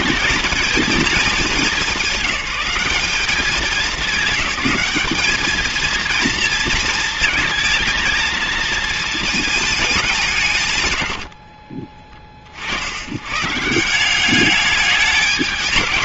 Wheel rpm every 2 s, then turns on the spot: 220, 190, 200, 230, 230, 130, 50, 210.
none